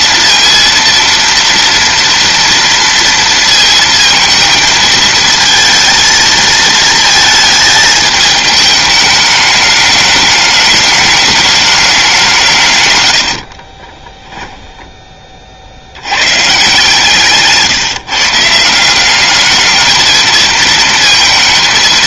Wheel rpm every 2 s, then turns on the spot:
230, 230, 230, 220, 210, 210, 150, 10, 140, 160, 230.
14-16